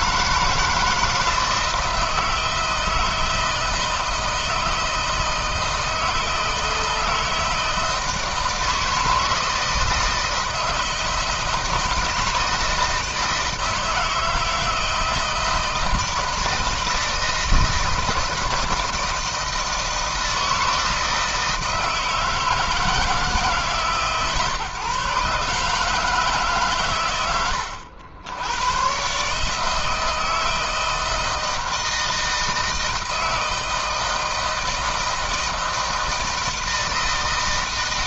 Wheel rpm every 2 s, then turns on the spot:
160, 170, 160, 160, 160, 160, 160, 160, 160, 160, 160, 160, 140, 140, 100, 160, 160, 160, 160.
none